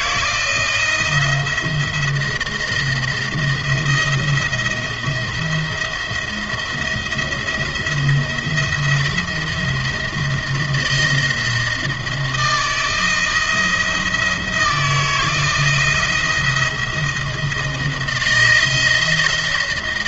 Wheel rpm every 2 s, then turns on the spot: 170, 170, 170, 170, 170, 170, 160, 160, 170, 170.
none